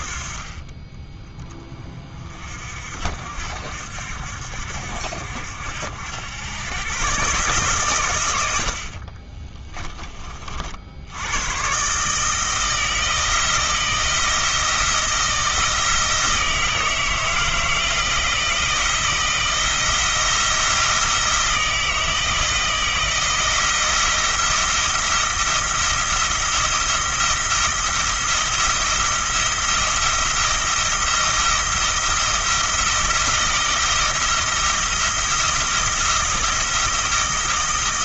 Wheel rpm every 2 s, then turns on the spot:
20, 50, 70, 120, 60, 70, 160, 160, 160, 170, 170, 170, 170, 170, 170, 170, 170, 170, 170.
none